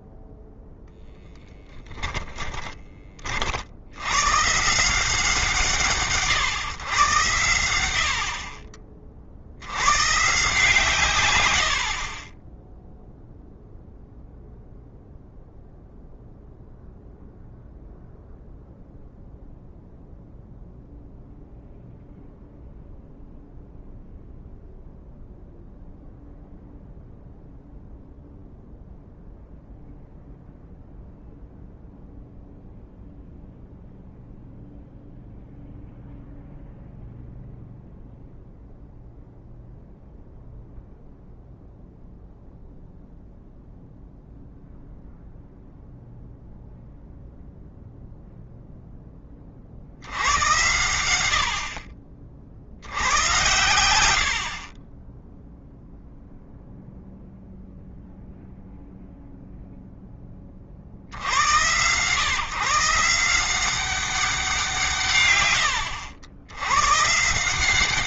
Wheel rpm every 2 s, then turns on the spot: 0, 20, 160, 110, 40, 140, 0, 0, 0, 0, 0, 0, 0, 0, 0, 0, 0, 0, 0, 0, 0, 0, 0, 0, 10, 100, 90, 20, 0, 0, 70, 160, 160, 130.
2-4